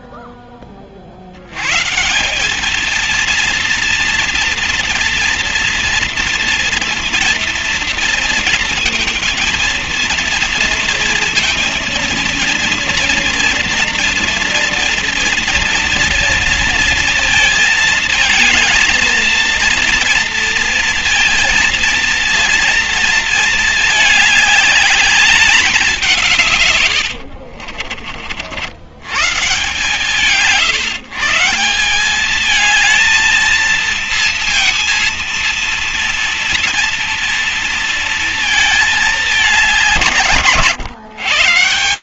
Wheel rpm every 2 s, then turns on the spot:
0, 150, 230, 230, 230, 230, 230, 240, 230, 220, 230, 230, 220, 180, 40, 150, 180, 230, 230, 230, 170.
none